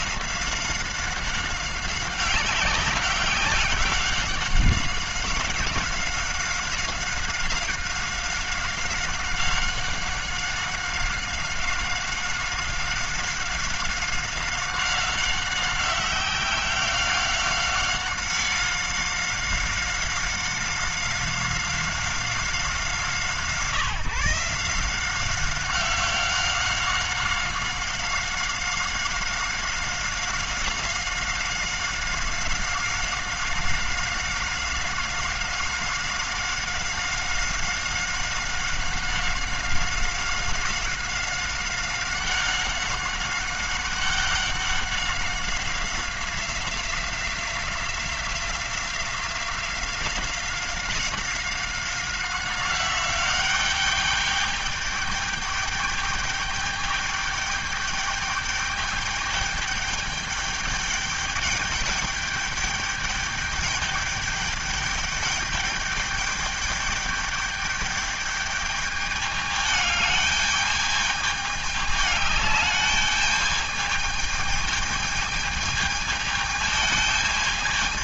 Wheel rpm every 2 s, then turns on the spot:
190, 190, 190, 190, 190, 190, 190, 190, 190, 190, 190, 180, 160, 190, 190, 190, 190, 190, 190, 190, 190, 190, 190, 180, 180, 190, 190, 200, 210, 210, 210, 210, 210, 210, 210, 210, 210, 220, 220.
none